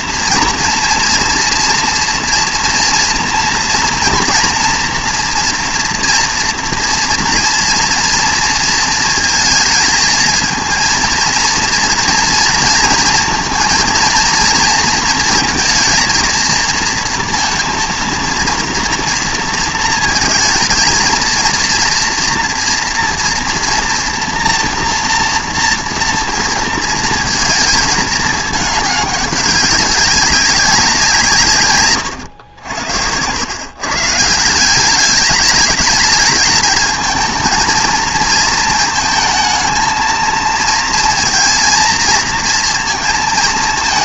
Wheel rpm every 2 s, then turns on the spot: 230, 230, 230, 230, 230, 220, 230, 230, 230, 230, 220, 230, 230, 230, 210, 200, 100, 180, 220, 220, 230, 230.
none